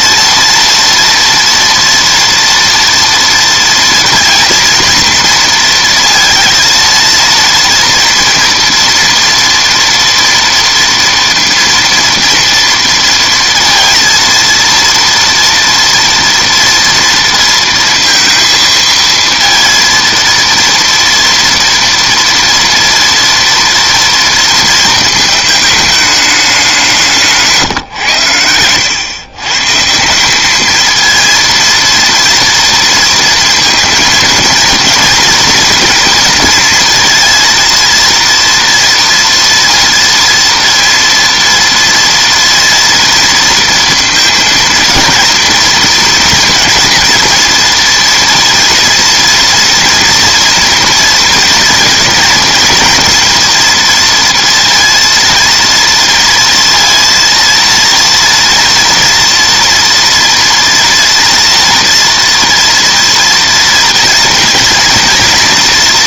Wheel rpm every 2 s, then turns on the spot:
230, 230, 230, 230, 230, 230, 230, 230, 230, 230, 230, 230, 230, 190, 100, 220, 230, 230, 230, 230, 230, 230, 230, 240, 230, 230, 230, 230, 230, 230, 230, 230, 230.
none